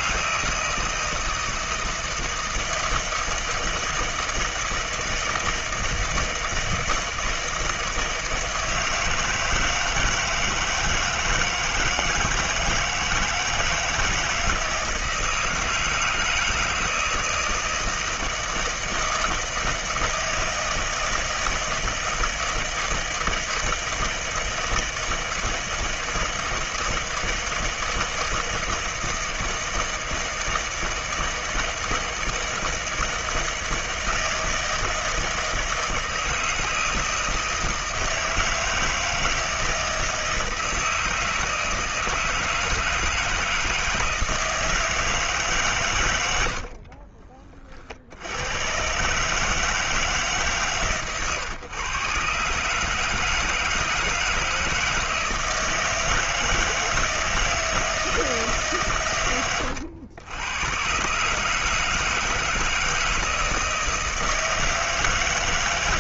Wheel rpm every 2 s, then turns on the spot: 160, 160, 160, 160, 160, 160, 160, 160, 160, 160, 160, 160, 160, 160, 160, 160, 160, 160, 160, 160, 160, 160, 160, 70, 120, 140, 140, 160, 160, 140, 110, 160, 160.
46-48